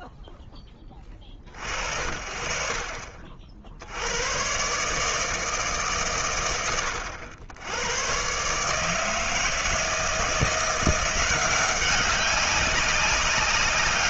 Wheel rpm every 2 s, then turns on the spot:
40, 50, 160, 100, 160, 180, 180.
none